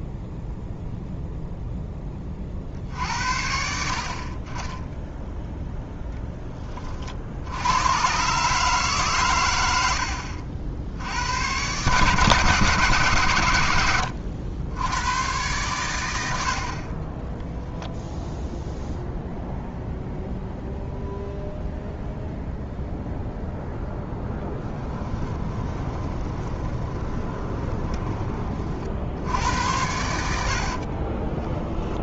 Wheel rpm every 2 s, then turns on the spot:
0, 50, 20, 20, 150, 70, 150, 90, 50, 0, 0, 0, 20, 20, 50, 50.
24-28 30-32